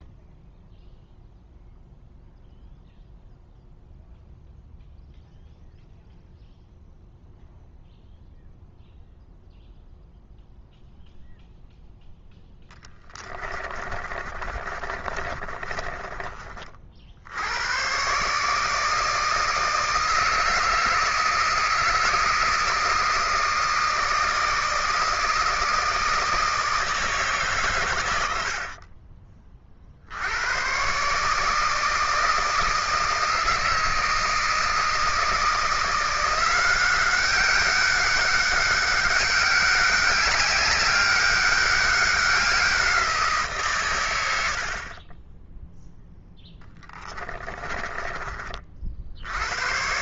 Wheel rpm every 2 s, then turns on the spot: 0, 0, 0, 0, 0, 0, 0, 30, 30, 140, 160, 160, 160, 160, 100, 70, 160, 160, 170, 200, 200, 190, 100, 0, 20.
14-18